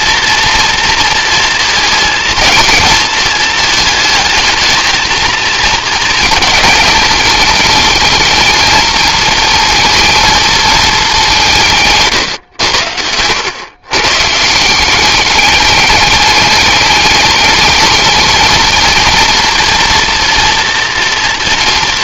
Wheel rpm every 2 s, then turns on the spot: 230, 220, 230, 220, 230, 160, 110, 210, 220, 240, 230.
10-12